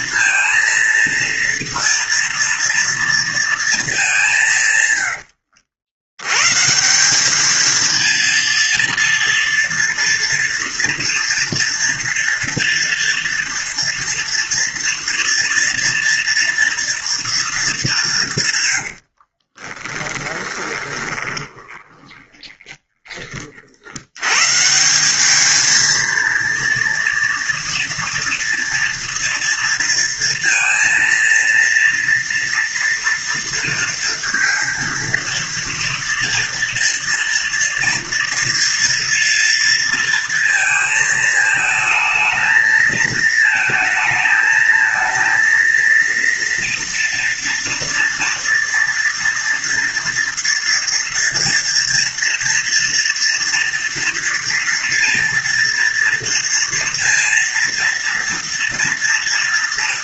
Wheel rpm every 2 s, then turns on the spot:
230, 230, 130, 180, 230, 230, 230, 230, 240, 100, 20, 20, 170, 230, 230, 230, 230, 230, 230, 230, 220, 220, 220, 230, 230, 230, 230, 230, 230, 230.
18-22